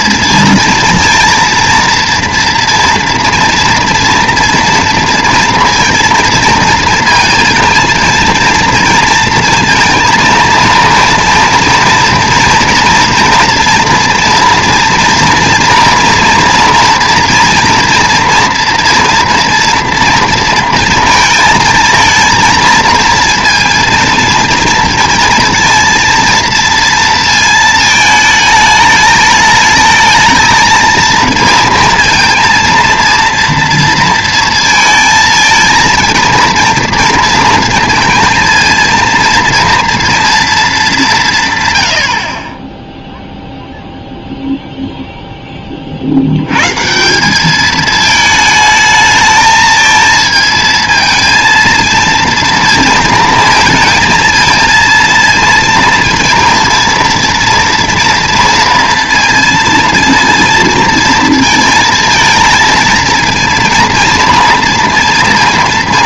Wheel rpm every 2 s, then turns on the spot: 230, 230, 230, 230, 230, 230, 230, 230, 230, 230, 230, 230, 230, 230, 220, 230, 230, 220, 230, 230, 220, 10, 0, 150, 220, 230, 230, 230, 230, 230, 230, 230, 230.
none